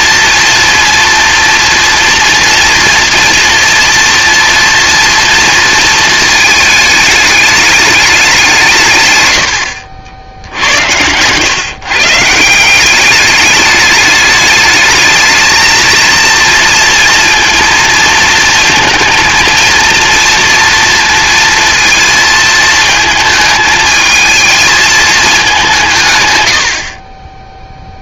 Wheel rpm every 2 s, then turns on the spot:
230, 230, 230, 220, 150, 90, 180, 210, 230, 230, 230, 220, 220, 70.
none